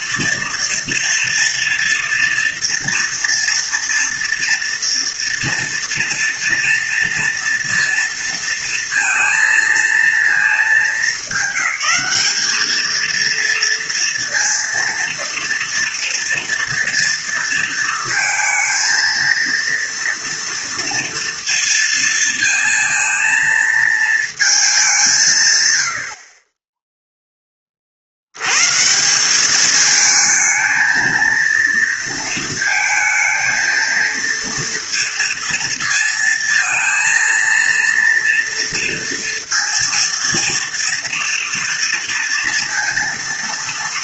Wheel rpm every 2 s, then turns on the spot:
230, 230, 240, 230, 230, 210, 210, 230, 240, 220, 230, 230, 210, 30, 130, 220, 220, 230, 230, 230, 230, 230.
none